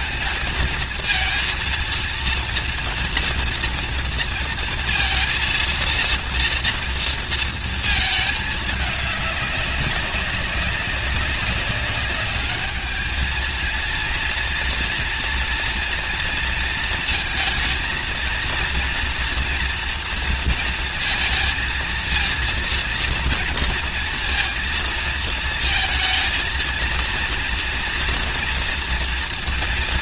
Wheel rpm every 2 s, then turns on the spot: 230, 230, 230, 230, 210, 200, 220, 230, 230, 230, 230, 230, 230, 230, 230.
none